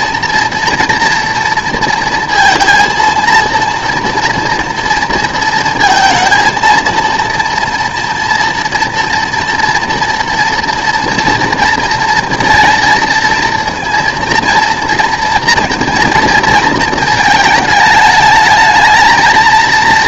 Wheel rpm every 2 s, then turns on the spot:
230, 230, 230, 230, 240, 230, 230, 230, 230, 220.
none